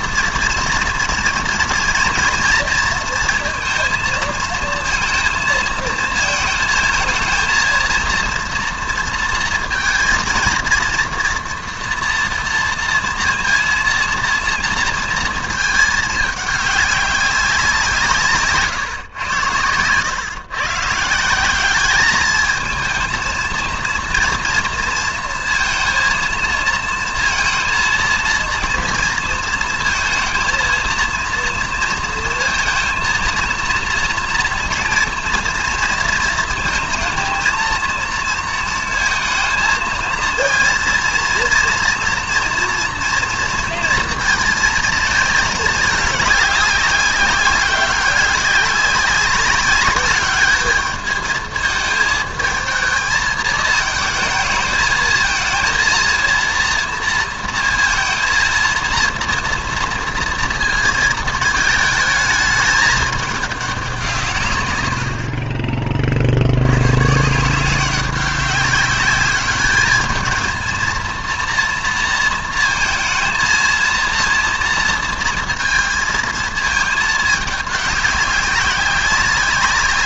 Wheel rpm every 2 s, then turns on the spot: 230, 230, 230, 220, 230, 230, 230, 230, 200, 140, 140, 220, 230, 230, 230, 230, 220, 230, 230, 230, 230, 230, 220, 200, 200, 210, 220, 220, 230, 230, 230, 210, 80, 110, 200, 230, 220, 230, 220, 190.
64-66